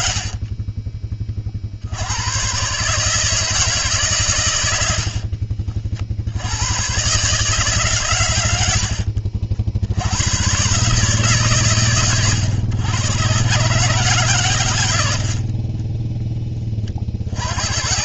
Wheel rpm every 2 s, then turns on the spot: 20, 150, 70, 130, 70, 140, 120, 80, 50.
14-16